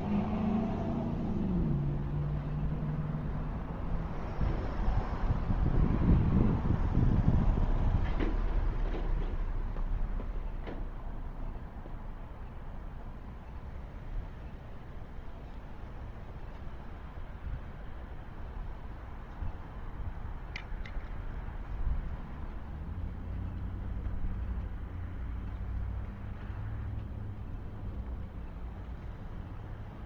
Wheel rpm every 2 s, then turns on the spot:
0, 0, 0, 0, 0, 0, 0, 0, 0, 0, 0, 0, 0, 0, 0.
none